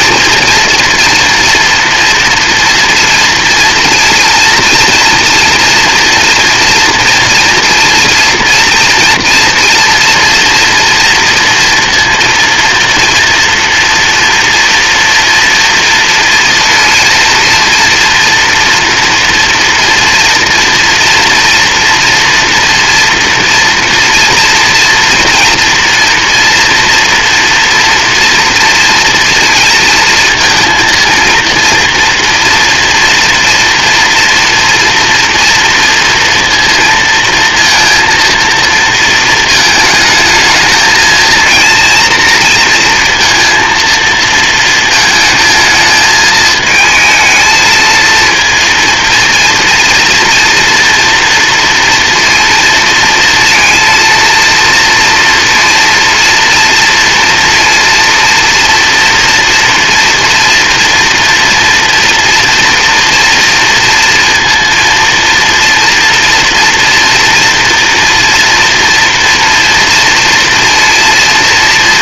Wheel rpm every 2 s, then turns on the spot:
240, 240, 230, 240, 230, 230, 230, 230, 230, 230, 230, 230, 240, 230, 230, 230, 240, 240, 230, 230, 220, 230, 220, 220, 230, 230, 230, 230, 230, 230, 230, 230, 230, 230, 240, 230.
none